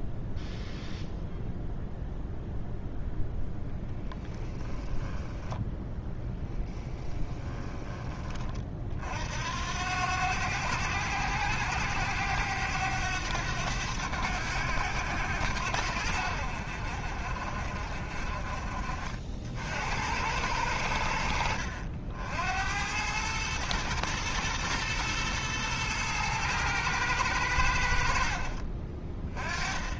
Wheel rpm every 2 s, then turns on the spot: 0, 0, 20, 10, 50, 90, 100, 90, 60, 50, 90, 90, 120, 110, 50.
4-8